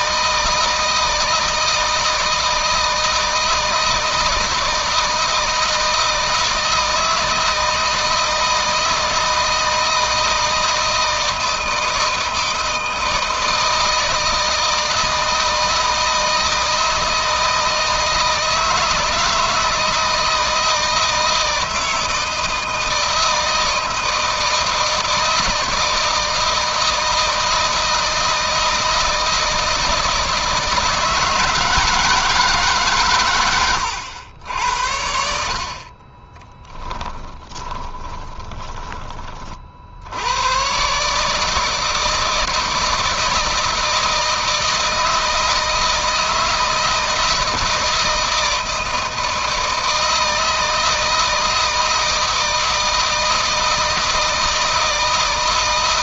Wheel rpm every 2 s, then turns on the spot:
160, 160, 160, 160, 160, 160, 160, 160, 160, 160, 160, 160, 170, 160, 160, 160, 140, 80, 30, 20, 130, 160, 160, 160, 160, 160, 160, 160.
36-38